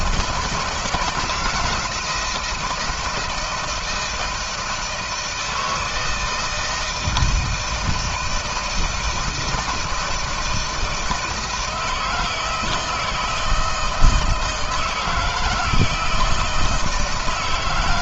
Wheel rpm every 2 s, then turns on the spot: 170, 160, 160, 160, 160, 160, 160, 160, 160.
none